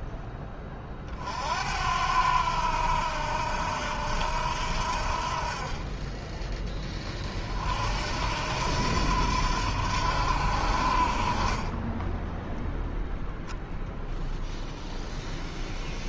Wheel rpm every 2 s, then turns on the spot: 20, 80, 70, 20, 80, 70, 0, 0.
none